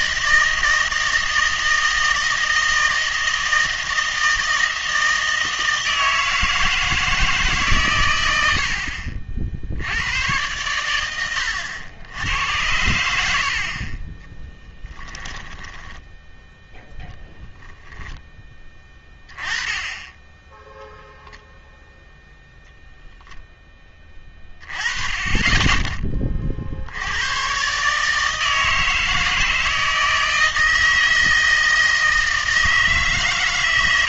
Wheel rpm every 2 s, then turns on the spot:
160, 160, 160, 160, 70, 110, 90, 10, 0, 10, 0, 0, 20, 60, 160, 160, 160.
14-16